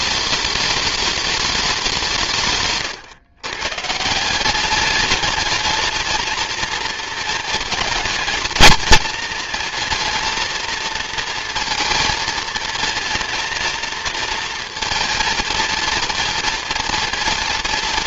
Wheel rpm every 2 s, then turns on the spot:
210, 130, 200, 220, 220, 230, 230, 230, 230.
2-4